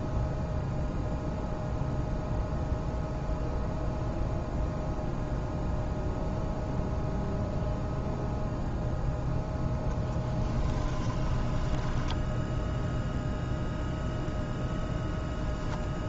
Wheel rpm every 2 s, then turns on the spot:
0, 0, 0, 0, 0, 10, 0, 0.
10-12